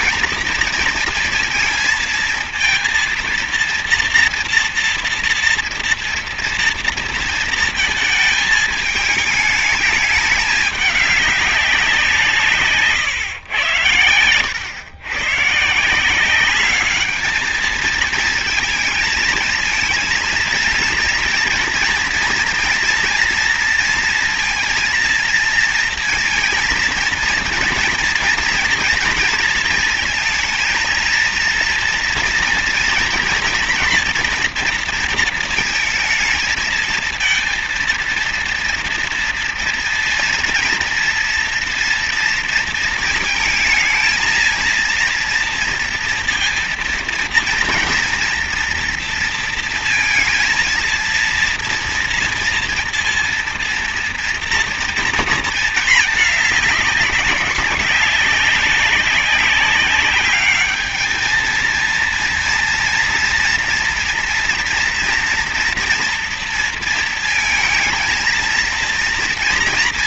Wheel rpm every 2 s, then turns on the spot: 230, 230, 230, 230, 220, 210, 140, 110, 200, 230, 230, 230, 230, 230, 230, 230, 230, 230, 220, 230, 230, 230, 230, 230, 230, 230, 230, 230, 210, 190, 210, 230, 240, 230, 230.
none